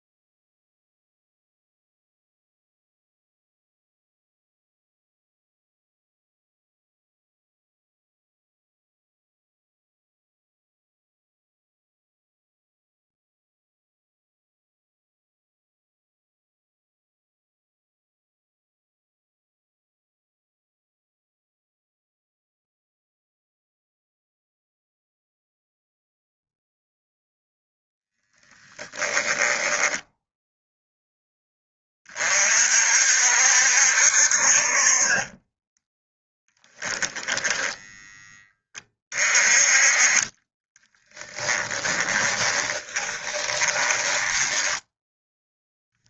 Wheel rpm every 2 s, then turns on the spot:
0, 0, 0, 0, 0, 0, 0, 0, 0, 0, 0, 0, 0, 0, 10, 10, 60, 40, 10, 30, 20, 20, 10.
28-30 36-38 40-46